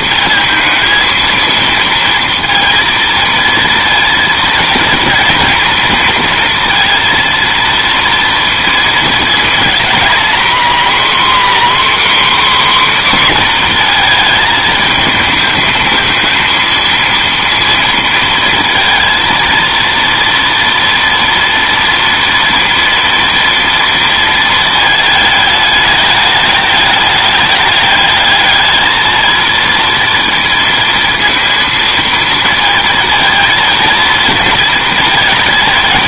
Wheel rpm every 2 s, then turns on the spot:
230, 230, 230, 230, 230, 250, 270, 220, 230, 230, 230, 230, 220, 210, 220, 230, 230, 230.
none